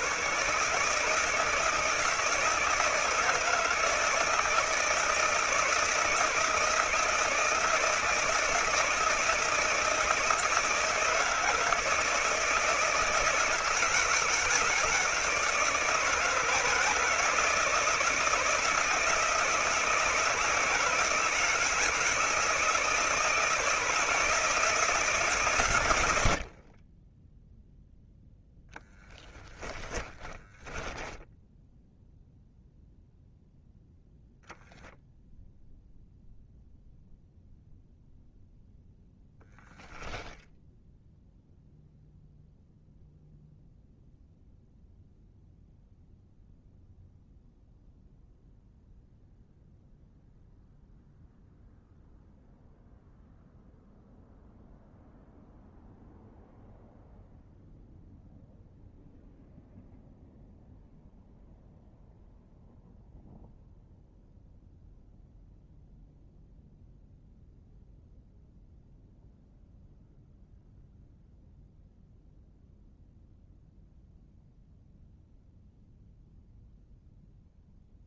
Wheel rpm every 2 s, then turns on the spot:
150, 160, 160, 160, 160, 160, 160, 160, 160, 160, 160, 160, 160, 20, 20, 10, 0, 0, 0, 0, 0, 0, 0, 0, 0, 0, 0, 0, 0, 0, 0, 0, 0, 0, 0, 0, 0, 0, 0.
28-32